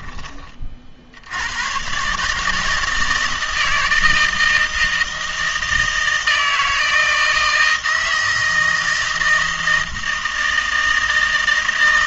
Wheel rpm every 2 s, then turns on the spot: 40, 160, 160, 160, 160, 160.
none